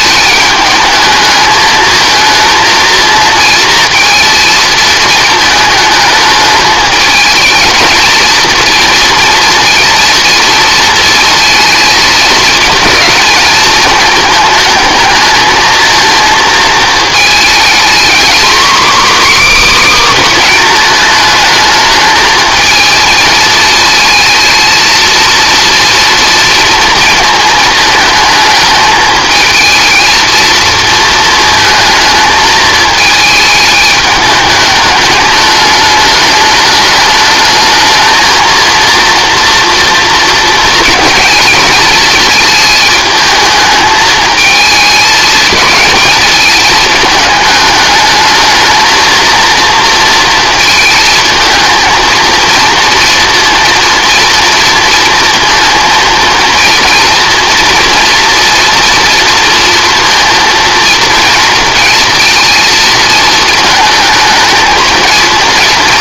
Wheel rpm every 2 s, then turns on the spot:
210, 230, 220, 210, 230, 230, 220, 220, 230, 280, 230, 220, 230, 230, 220, 230, 220, 210, 210, 230, 230, 220, 210, 210, 230, 220, 230, 230, 230, 230, 230, 230, 230.
none